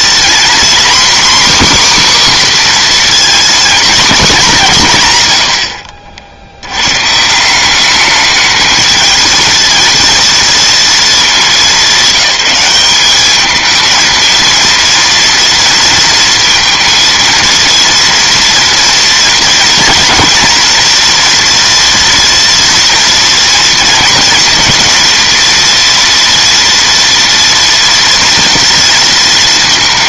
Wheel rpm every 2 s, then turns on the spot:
260, 250, 170, 120, 220, 230, 200, 230, 230, 230, 230, 230, 230, 230, 230.
none